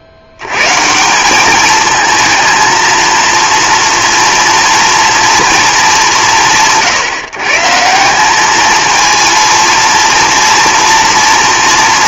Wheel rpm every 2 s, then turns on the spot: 140, 230, 230, 160, 220, 230.
none